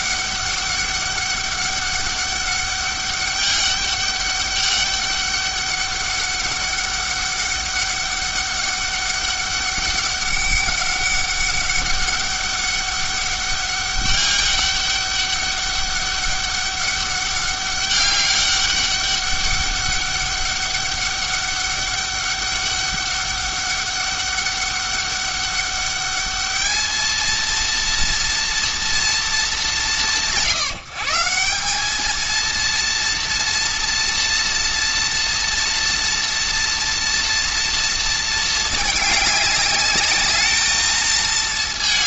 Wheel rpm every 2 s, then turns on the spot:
200, 200, 200, 200, 200, 200, 200, 200, 200, 200, 200, 200, 200, 220, 230, 170, 230, 230, 230, 210, 220.
none